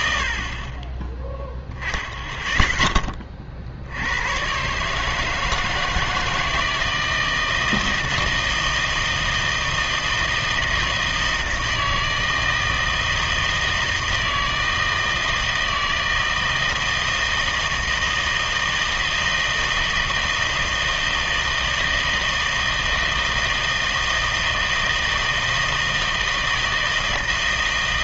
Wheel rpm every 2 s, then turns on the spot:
40, 10, 130, 160, 160, 160, 160, 160, 160, 160, 160, 160, 160, 160.
none